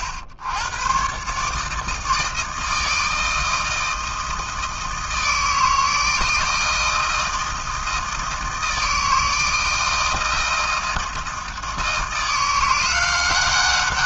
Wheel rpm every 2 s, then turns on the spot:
100, 160, 160, 160, 160, 160, 180.
none